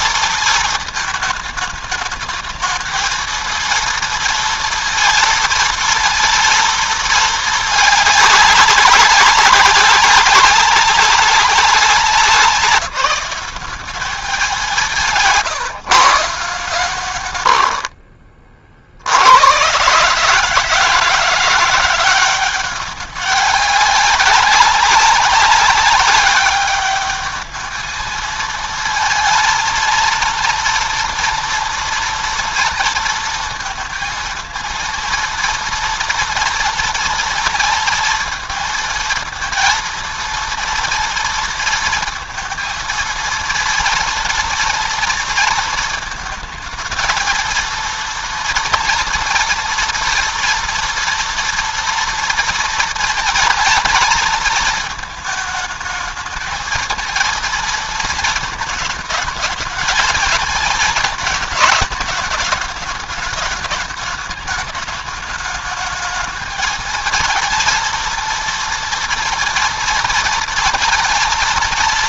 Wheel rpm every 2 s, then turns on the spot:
220, 220, 230, 230, 200, 190, 190, 180, 140, 40, 150, 190, 200, 200, 220, 230, 230, 230, 230, 230, 230, 230, 230, 220, 230, 230, 230, 220, 220, 220, 230, 210, 210, 220, 230, 230.
none